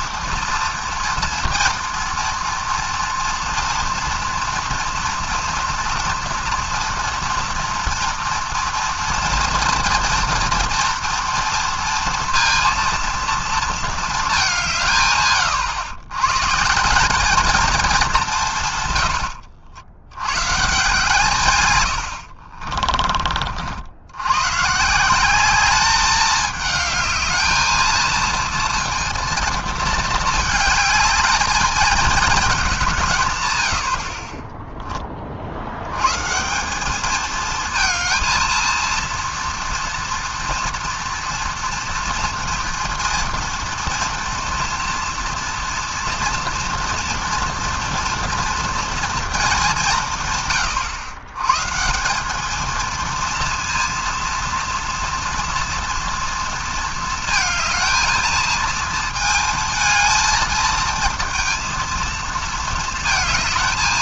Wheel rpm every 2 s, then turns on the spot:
230, 230, 230, 230, 240, 230, 230, 160, 160, 120, 150, 40, 140, 210, 230, 220, 190, 20, 190, 230, 230, 230, 230, 230, 230, 120, 220, 230, 230, 230, 220, 230.
22-24